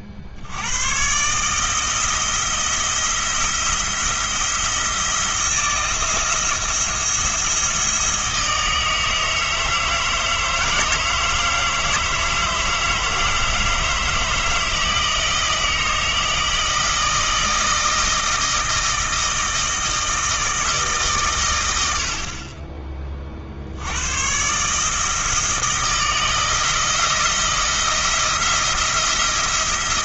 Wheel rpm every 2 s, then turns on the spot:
80, 170, 160, 170, 160, 160, 160, 160, 160, 160, 150, 30, 150, 160, 170.
none